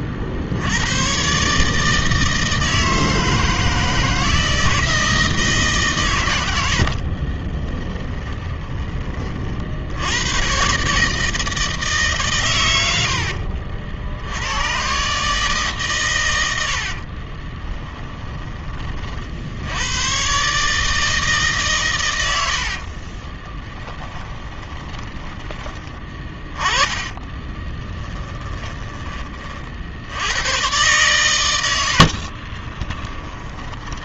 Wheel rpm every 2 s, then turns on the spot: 80, 160, 160, 70, 20, 130, 90, 110, 70, 30, 150, 60, 20, 20, 20, 110, 20.
6-8 16-18 22-30 32-34